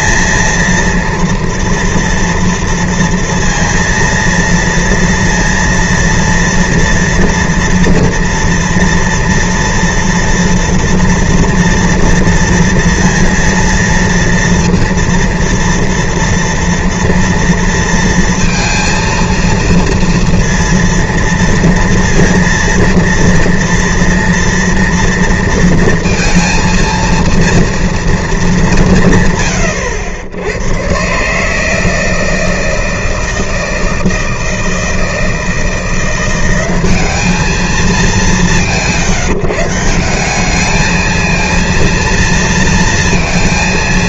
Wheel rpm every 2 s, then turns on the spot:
230, 230, 230, 230, 230, 230, 230, 230, 230, 230, 240, 230, 230, 230, 210, 90, 160, 160, 180, 190, 190, 230.
none